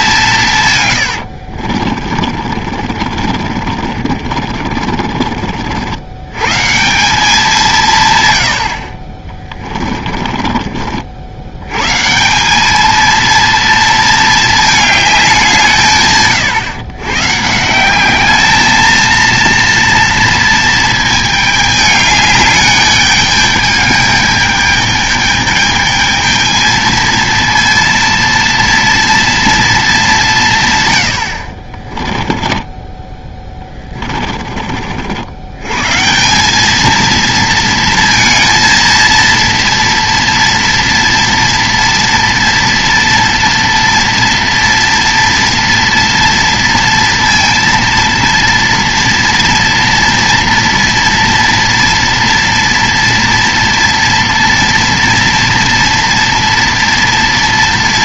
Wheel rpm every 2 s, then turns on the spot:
160, 40, 30, 110, 100, 30, 190, 220, 130, 210, 230, 210, 210, 220, 230, 160, 20, 30, 190, 230, 230, 230, 230, 230, 230, 230, 230, 230, 230.
2-6 8-12 32-34